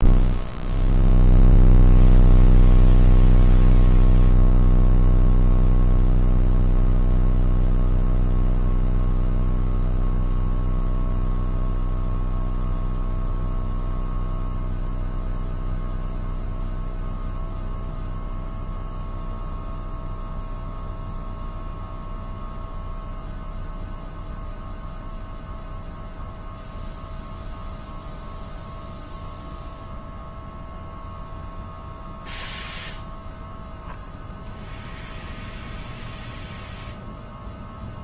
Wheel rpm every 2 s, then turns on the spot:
0, 0, 0, 0, 0, 0, 0, 0, 0, 0, 0, 0, 0, 0, 0, 0, 0, 0, 0.
none